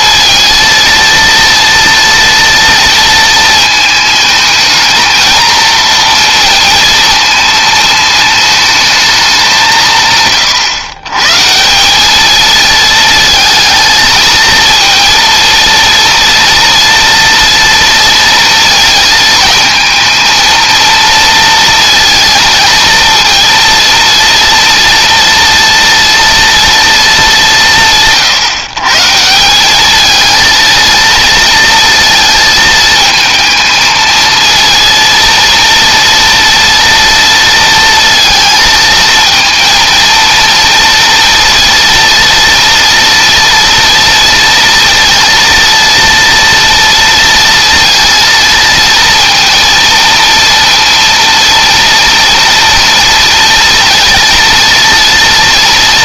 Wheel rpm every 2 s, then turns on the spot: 230, 230, 220, 230, 220, 130, 220, 230, 230, 220, 230, 230, 230, 220, 140, 230, 220, 230, 230, 220, 230, 230, 230, 230, 230, 230, 230, 230.
none